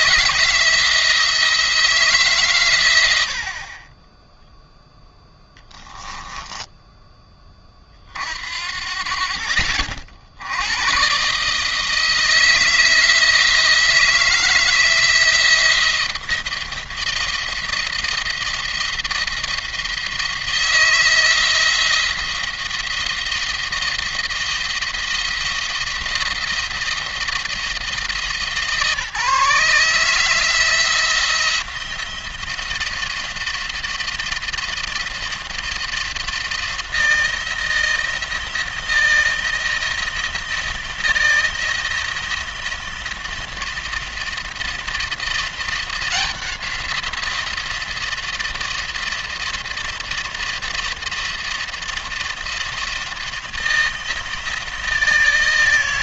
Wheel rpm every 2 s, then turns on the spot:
160, 120, 0, 10, 60, 110, 160, 170, 170, 170, 160, 170, 170, 170, 150, 160, 170, 170, 170, 160, 170, 170, 170, 180, 170, 170, 170, 160.
6-8